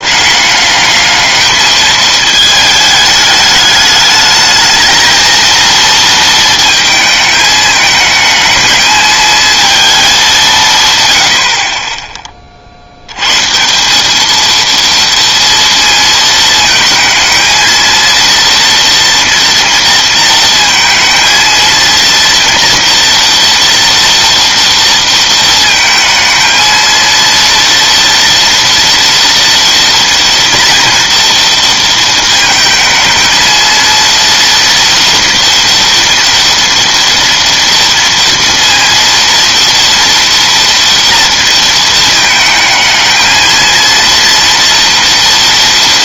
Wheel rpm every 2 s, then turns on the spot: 210, 220, 220, 220, 220, 150, 60, 230, 220, 230, 230, 230, 230, 230, 230, 230, 220, 240, 240, 230, 230, 220, 240.
none